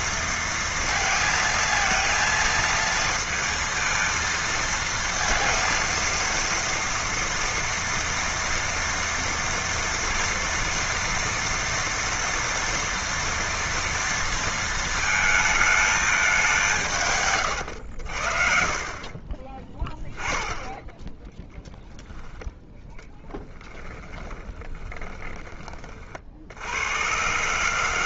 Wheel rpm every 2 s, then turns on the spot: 230, 230, 220, 230, 230, 240, 230, 230, 200, 50, 10, 10, 20, 60.
24-26